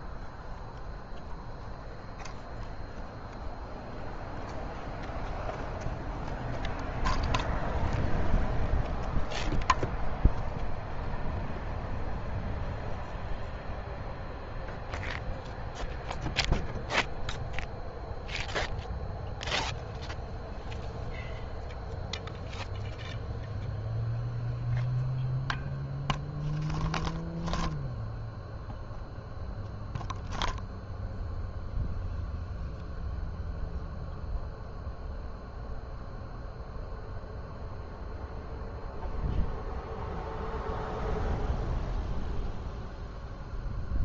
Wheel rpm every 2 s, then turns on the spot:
0, 0, 0, 0, 0, 0, 0, 0, 0, 0, 0, 0, 0, 0, 0, 0, 0, 0, 0, 0, 0, 0.
none